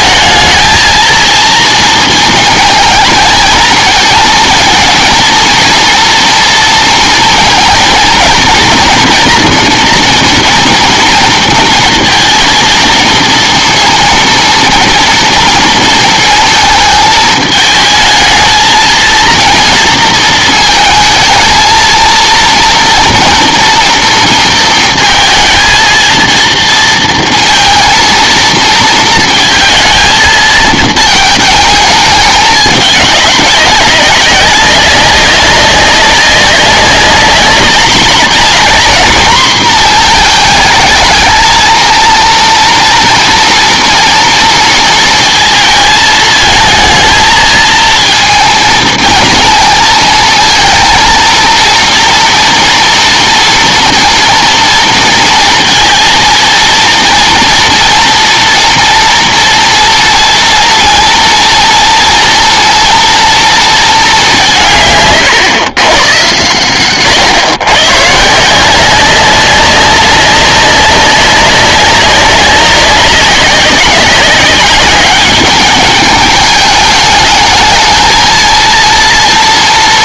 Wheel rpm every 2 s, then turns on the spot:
220, 220, 230, 230, 230, 230, 220, 230, 220, 220, 220, 230, 230, 230, 230, 220, 200, 190, 200, 230, 220, 230, 230, 220, 230, 230, 230, 230, 230, 230, 230, 230, 160, 120, 170, 200, 190, 200, 220, 230.
none